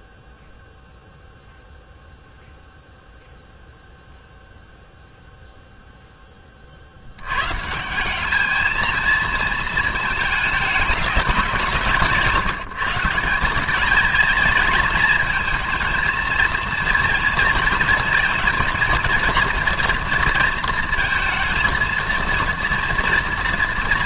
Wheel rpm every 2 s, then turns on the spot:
0, 0, 0, 40, 220, 220, 150, 230, 230, 230, 230, 240.
none